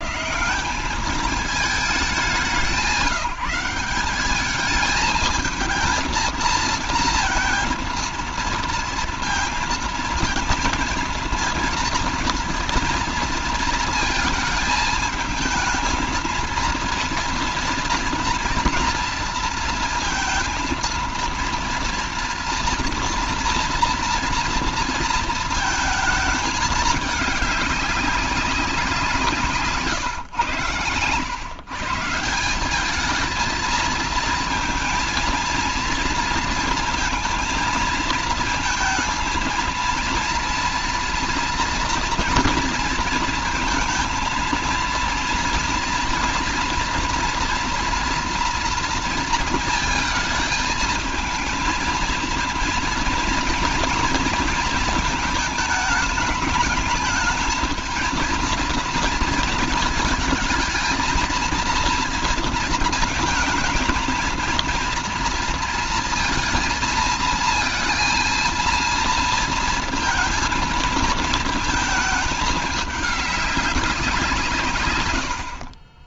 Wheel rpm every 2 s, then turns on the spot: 160, 200, 210, 230, 230, 230, 230, 230, 230, 230, 230, 240, 230, 220, 190, 120, 170, 230, 230, 230, 230, 230, 220, 230, 230, 220, 230, 230, 210, 230, 230, 230, 230, 230, 230, 230, 210, 150.
none